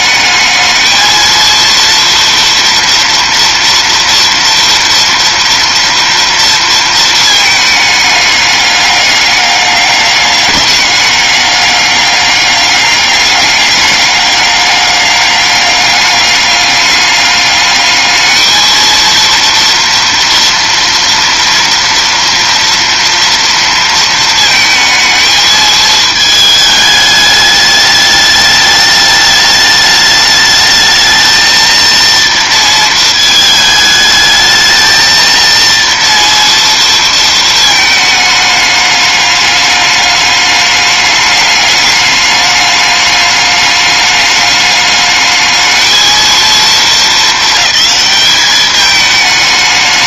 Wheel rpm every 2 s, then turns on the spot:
220, 230, 230, 230, 200, 200, 200, 200, 200, 230, 230, 230, 220, 210, 210, 220, 230, 220, 230, 210, 210, 210, 210, 220, 210.
none